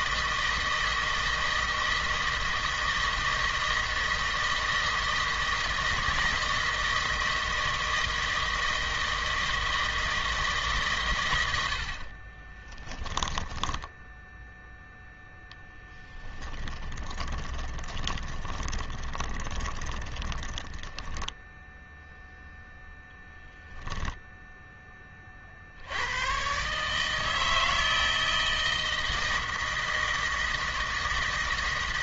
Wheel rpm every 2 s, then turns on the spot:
160, 160, 160, 160, 160, 140, 10, 0, 20, 20, 10, 0, 10, 150, 160, 160.
12-14 16-20